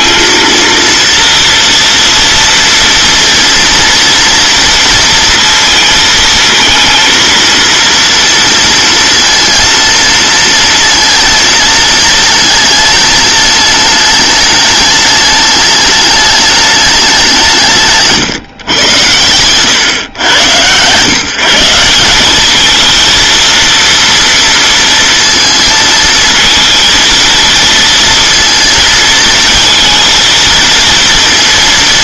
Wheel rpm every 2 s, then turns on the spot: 230, 230, 230, 230, 230, 230, 210, 210, 210, 130, 120, 220, 230, 220, 230, 230.
none